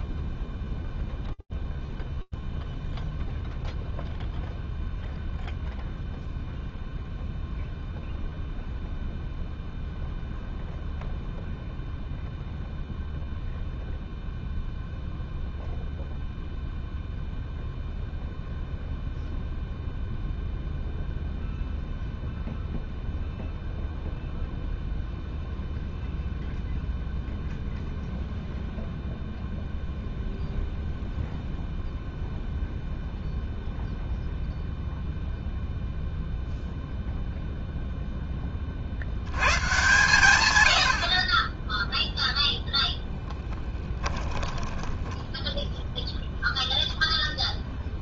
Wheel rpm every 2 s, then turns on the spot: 0, 0, 0, 0, 0, 0, 0, 0, 0, 0, 0, 0, 0, 0, 0, 0, 0, 0, 0, 120, 10, 10, 10, 0.
42-44